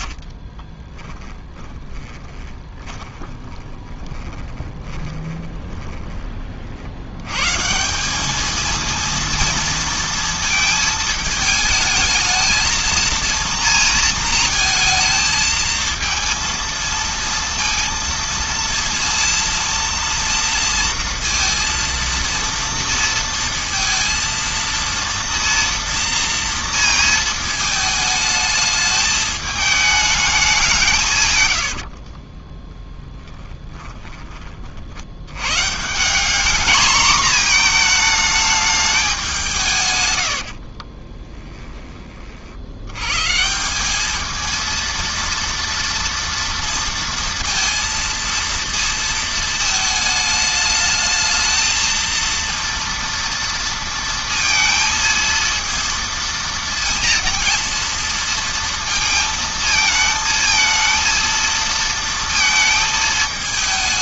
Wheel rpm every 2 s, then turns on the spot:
20, 20, 20, 60, 220, 220, 220, 220, 230, 230, 230, 230, 230, 230, 210, 180, 20, 40, 220, 220, 60, 70, 230, 230, 230, 210, 230, 230, 230, 230, 220, 230.
0-6 32-34 40-42